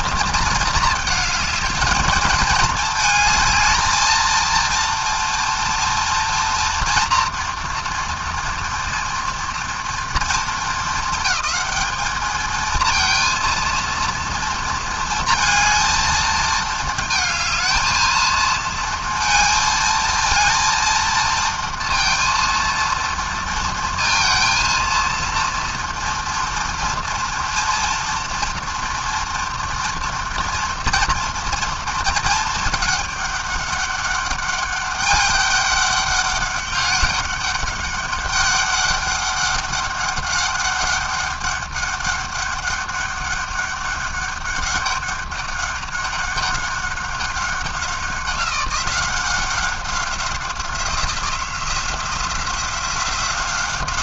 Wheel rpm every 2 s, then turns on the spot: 220, 220, 230, 230, 230, 220, 230, 230, 220, 230, 230, 230, 230, 230, 230, 230, 210, 200, 200, 200, 190, 200, 200, 190, 190, 180, 180.
none